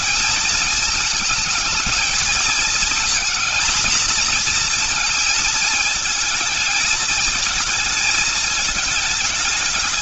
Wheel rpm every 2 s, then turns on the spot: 220, 220, 230, 220, 220.
none